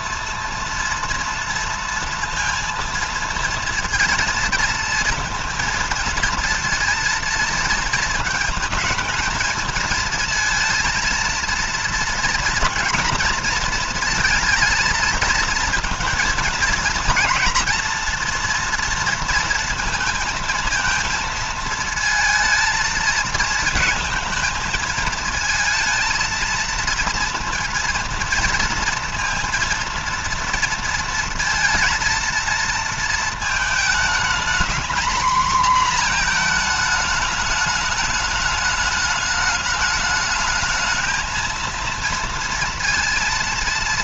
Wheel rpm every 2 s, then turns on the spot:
230, 230, 230, 230, 230, 230, 230, 230, 230, 230, 230, 220, 220, 230, 230, 230, 230, 230, 220, 210, 220, 230.
none